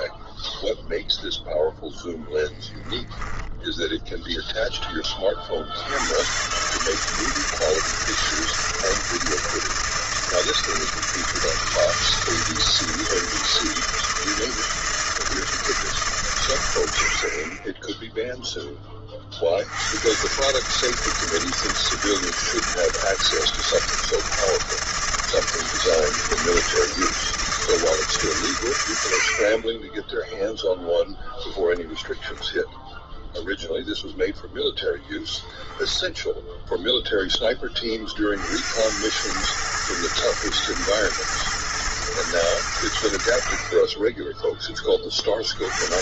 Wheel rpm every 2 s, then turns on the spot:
0, 0, 10, 130, 160, 160, 160, 160, 100, 10, 150, 160, 160, 160, 80, 0, 0, 0, 0, 70, 110, 90, 20.
none